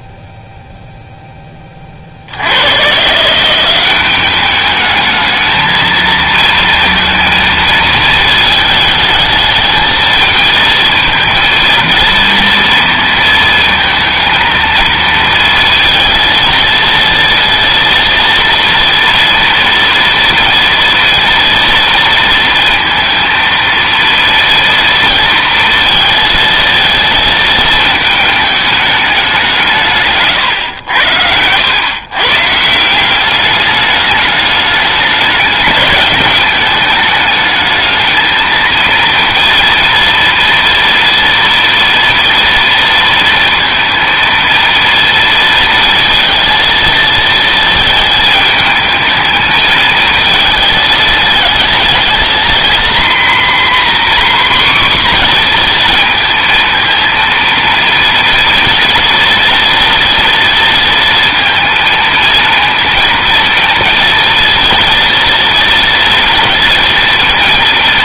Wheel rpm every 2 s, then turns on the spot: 0, 60, 200, 220, 220, 220, 230, 230, 230, 230, 240, 230, 230, 230, 220, 140, 130, 210, 210, 220, 230, 230, 230, 220, 220, 220, 230, 260, 230, 230, 230, 230, 230, 230.
30-32